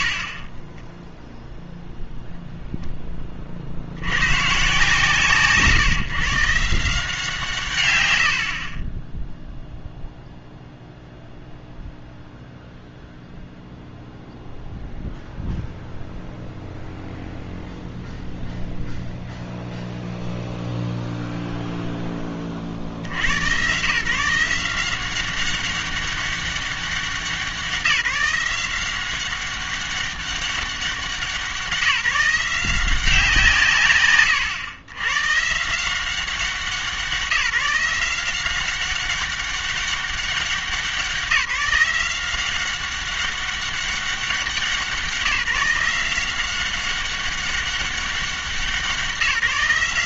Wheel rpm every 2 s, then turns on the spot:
40, 0, 140, 160, 40, 0, 0, 0, 0, 0, 0, 40, 170, 200, 180, 190, 180, 110, 180, 190, 190, 190, 190, 190, 180.
none